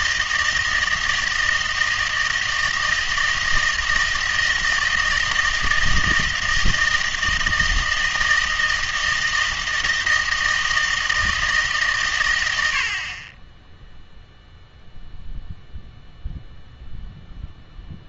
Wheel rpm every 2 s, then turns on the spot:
160, 160, 160, 160, 160, 160, 80, 0, 0.
none